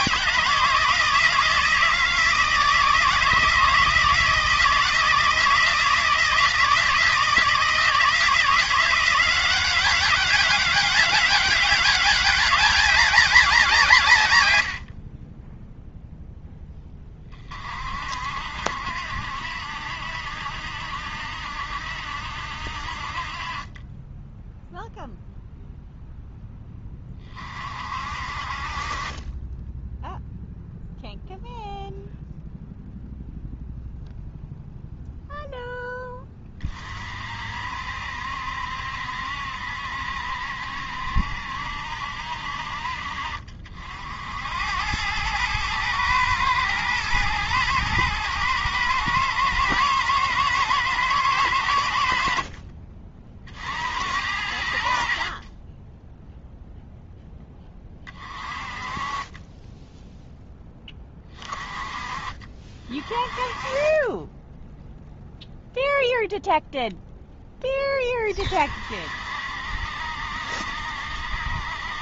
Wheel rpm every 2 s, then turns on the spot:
160, 160, 160, 160, 180, 200, 200, 60, 20, 70, 70, 60, 0, 20, 30, 0, 0, 0, 30, 70, 70, 50, 100, 110, 110, 110, 40, 70, 0, 30, 20, 40, 0, 0, 50, 70.
none